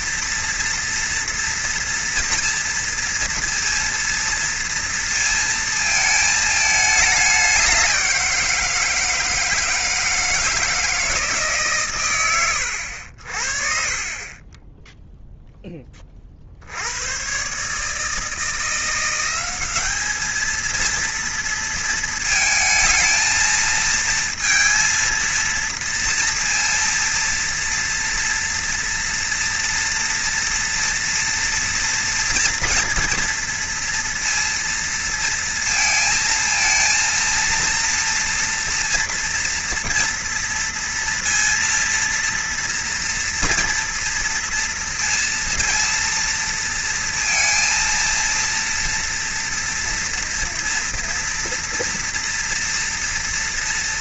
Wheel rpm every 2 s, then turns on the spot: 230, 230, 230, 220, 170, 160, 110, 20, 60, 170, 230, 220, 230, 230, 230, 230, 230, 230, 230, 230, 230, 230, 230, 230, 230, 230, 230.
none